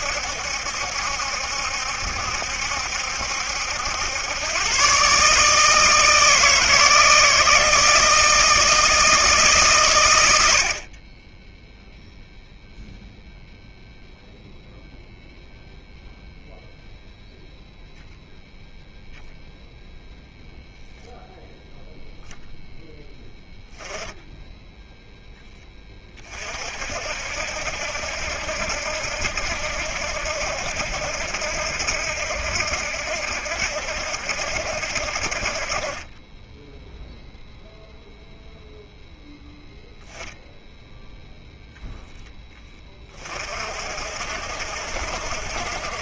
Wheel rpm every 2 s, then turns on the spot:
70, 70, 120, 160, 160, 60, 0, 0, 0, 0, 0, 0, 0, 50, 70, 70, 60, 60, 10, 0, 0, 20, 60.
none